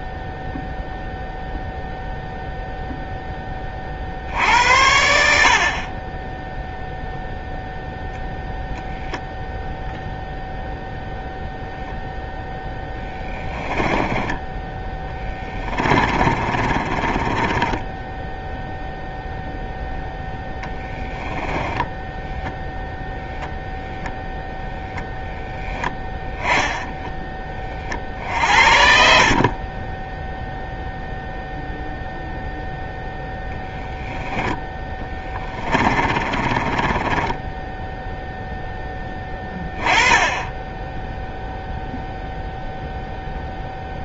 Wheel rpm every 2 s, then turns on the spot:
0, 10, 70, 0, 0, 0, 10, 10, 30, 0, 10, 0, 0, 20, 40, 0, 0, 10, 20, 10, 0, 0.
12-18 20-22 28-30 34-38